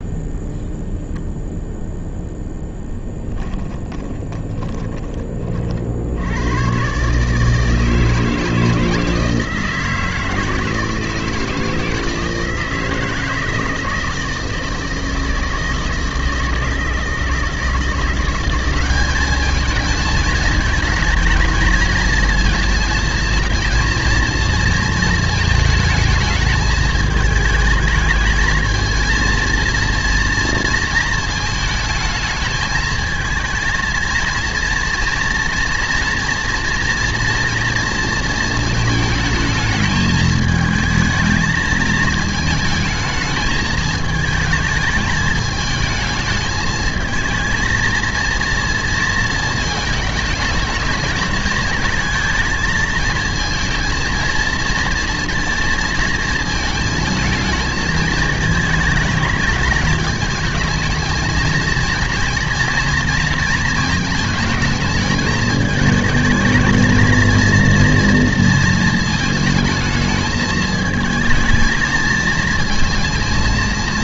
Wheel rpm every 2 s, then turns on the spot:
0, 0, 10, 120, 160, 160, 160, 160, 160, 190, 220, 230, 230, 220, 220, 230, 220, 230, 230, 220, 220, 220, 210, 220, 230, 220, 220, 230, 220, 220, 220, 230, 220, 220, 220, 220, 230.
4-6